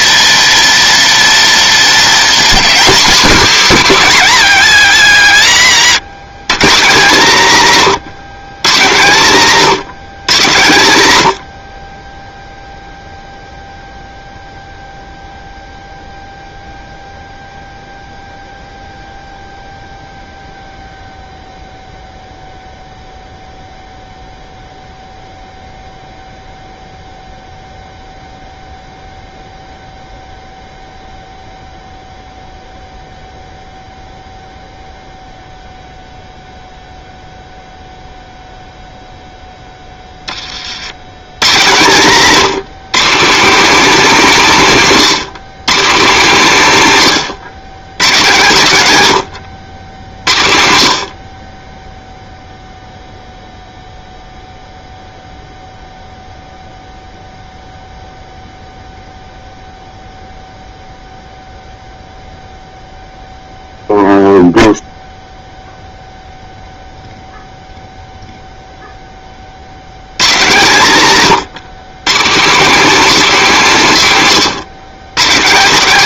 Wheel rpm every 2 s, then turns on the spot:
230, 250, 110, 170, 140, 130, 0, 0, 0, 0, 0, 0, 0, 0, 0, 0, 0, 0, 0, 0, 90, 180, 190, 190, 100, 70, 0, 0, 0, 0, 0, 0, 0, 0, 10, 140, 240, 170.
none